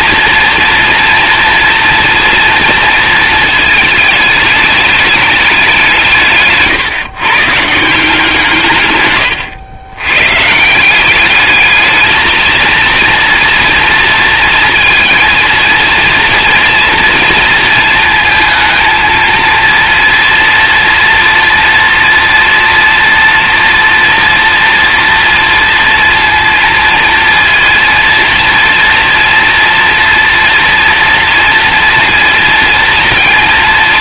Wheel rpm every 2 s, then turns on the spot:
230, 230, 210, 150, 140, 170, 230, 230, 230, 220, 230, 240, 230, 230, 230, 230, 230.
none